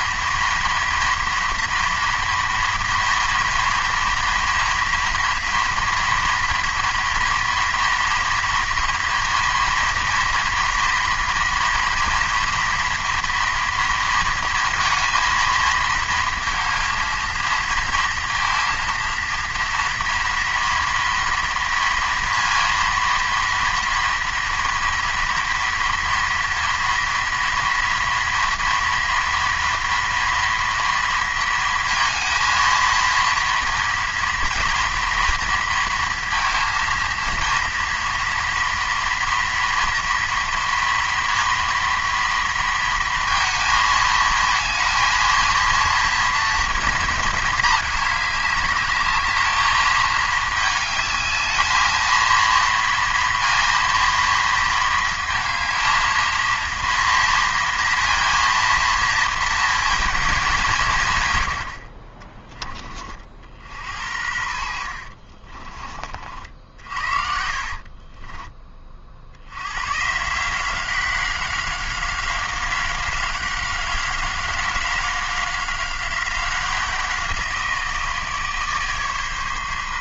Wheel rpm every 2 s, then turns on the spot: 230, 240, 230, 240, 230, 230, 230, 230, 230, 230, 230, 230, 230, 230, 240, 240, 230, 230, 230, 230, 230, 230, 230, 230, 210, 220, 230, 230, 230, 230, 210, 30, 70, 60, 30, 160, 190, 190, 180, 150.
64-68